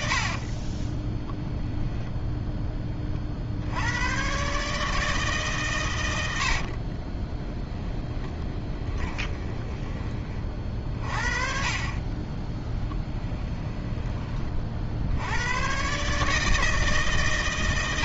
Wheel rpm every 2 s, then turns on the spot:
20, 20, 150, 30, 20, 40, 10, 60, 150.
0-2 6-10 12-14